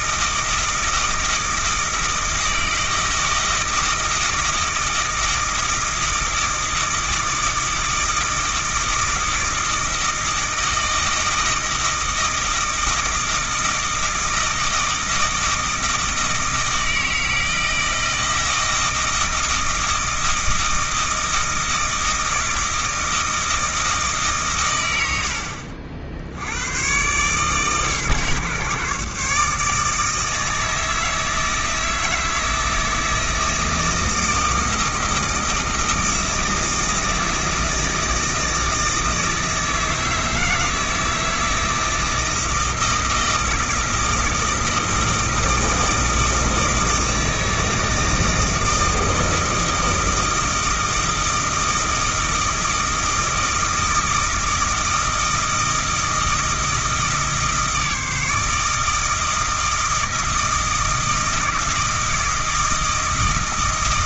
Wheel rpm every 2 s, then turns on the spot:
160, 160, 160, 160, 160, 160, 160, 160, 160, 160, 160, 160, 120, 90, 140, 160, 160, 160, 160, 160, 160, 160, 160, 160, 160, 160, 160, 160, 160, 160, 160, 160.
none